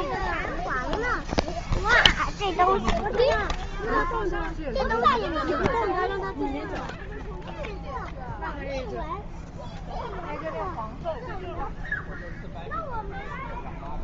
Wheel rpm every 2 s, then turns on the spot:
0, 0, 0, 0, 0, 0, 0.
none